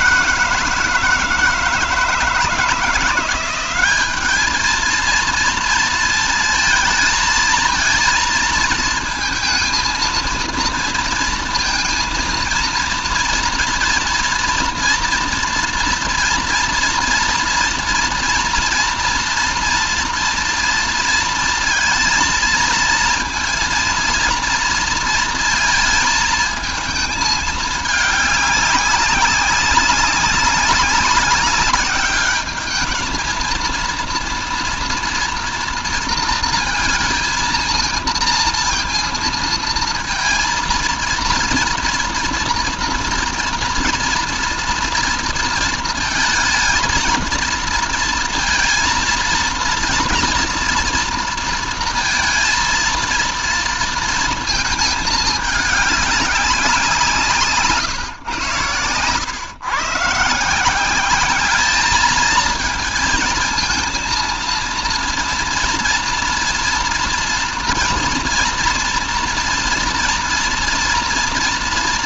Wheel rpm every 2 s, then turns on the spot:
160, 160, 220, 220, 230, 230, 230, 230, 230, 230, 230, 230, 230, 220, 210, 200, 210, 230, 230, 230, 230, 230, 230, 230, 230, 230, 230, 220, 180, 110, 170, 220, 230, 230, 240, 230.
none